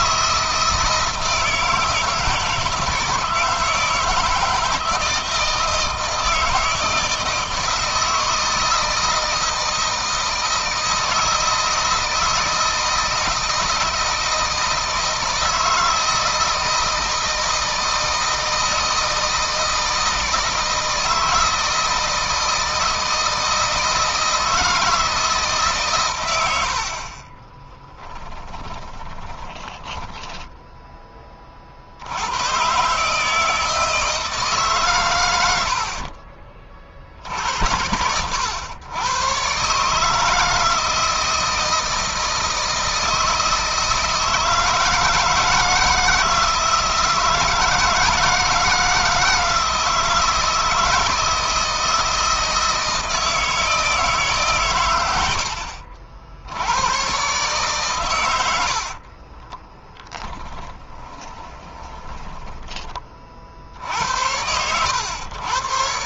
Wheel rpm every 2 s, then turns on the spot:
160, 160, 160, 160, 160, 160, 160, 160, 160, 160, 160, 160, 160, 60, 10, 10, 130, 130, 50, 100, 160, 160, 160, 160, 160, 160, 160, 110, 100, 50, 10, 20, 90.
28-30 58-62